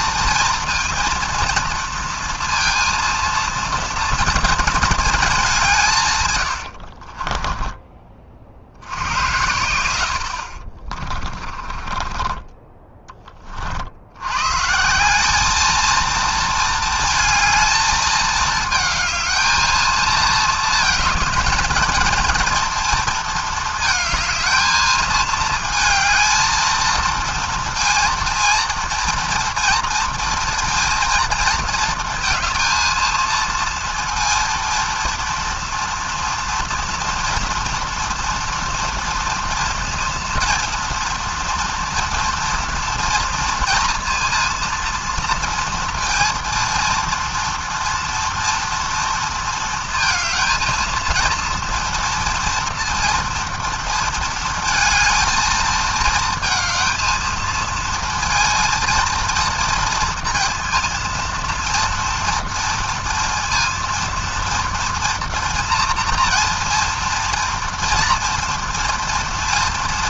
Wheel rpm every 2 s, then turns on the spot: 230, 230, 220, 80, 60, 50, 20, 140, 230, 220, 220, 230, 220, 230, 230, 230, 220, 230, 230, 230, 230, 230, 230, 230, 230, 220, 230, 230, 220, 230, 230, 230, 230, 230, 240.
6-8 10-12